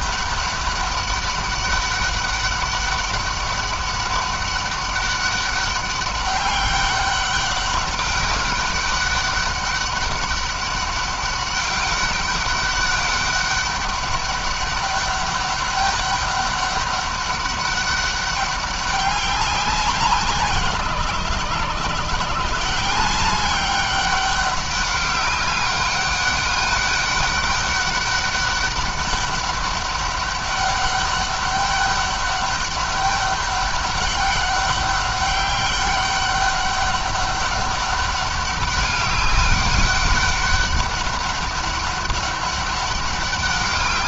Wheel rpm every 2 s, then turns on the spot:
200, 200, 200, 200, 200, 190, 200, 200, 200, 200, 150, 180, 200, 200, 200, 200, 200, 200, 200, 200, 200, 200.
none